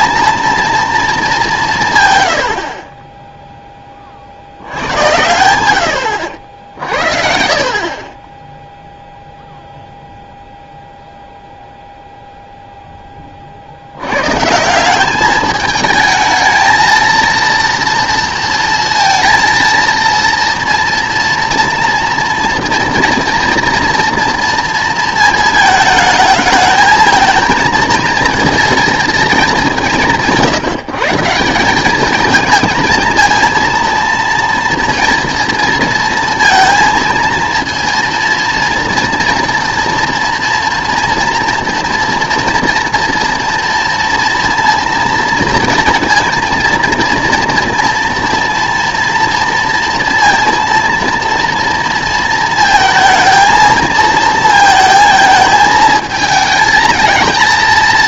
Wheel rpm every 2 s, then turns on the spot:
220, 30, 100, 60, 0, 0, 0, 180, 220, 230, 230, 230, 230, 220, 220, 160, 230, 230, 230, 240, 240, 230, 230, 230, 230, 230, 220, 220, 220.
none